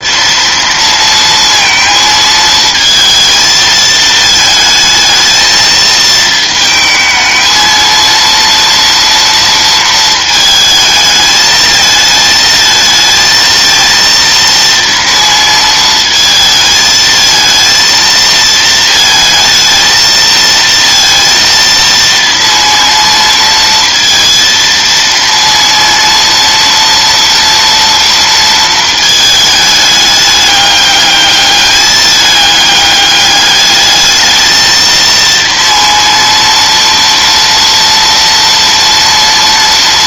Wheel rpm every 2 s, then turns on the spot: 230, 220, 220, 220, 230, 220, 220, 230, 220, 230, 230, 230, 230, 230, 220, 210, 210, 220, 230, 230.
none